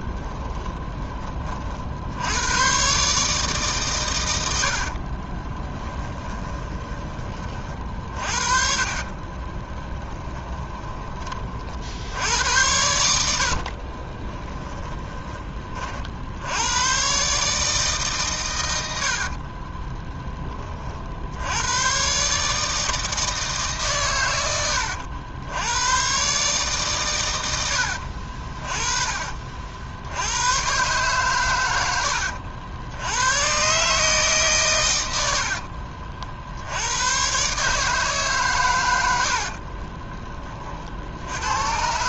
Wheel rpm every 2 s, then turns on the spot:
20, 120, 70, 20, 40, 10, 80, 10, 100, 70, 30, 150, 100, 140, 30, 120, 80, 130, 80, 110, 40.
0-2 4-12